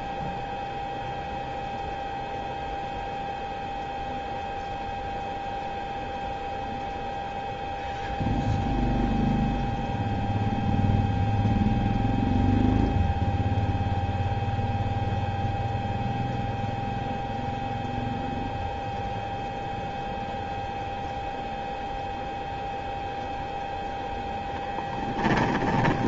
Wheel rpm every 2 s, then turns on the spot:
0, 0, 0, 0, 0, 0, 0, 0, 0, 0, 0, 0, 10.
none